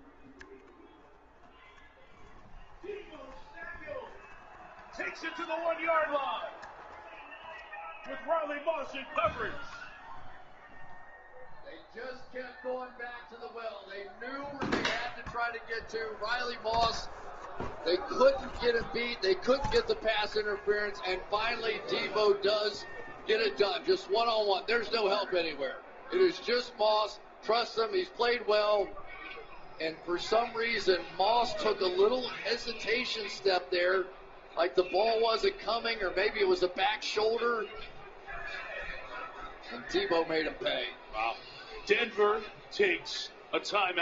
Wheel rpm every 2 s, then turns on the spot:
0, 0, 0, 0, 0, 0, 0, 0, 0, 0, 0, 0, 0, 0, 0, 0, 0, 0, 0, 0, 0, 0.
none